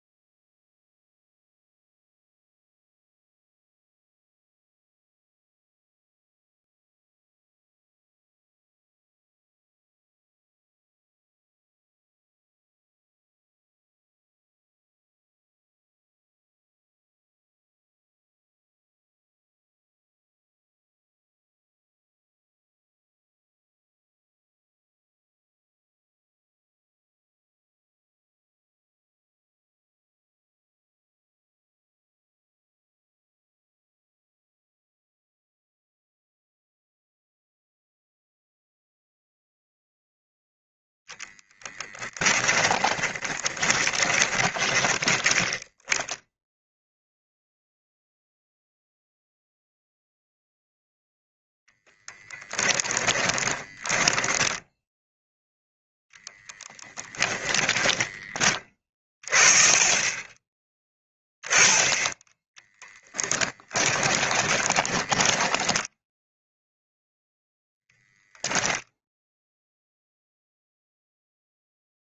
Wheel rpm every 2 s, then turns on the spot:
0, 0, 0, 0, 0, 0, 0, 0, 0, 0, 0, 0, 0, 0, 0, 0, 0, 0, 0, 0, 0, 10, 10, 0, 0, 0, 20, 10, 10, 30, 10, 10, 20, 0, 10, 0.
42-46 52-54 56-58 64-66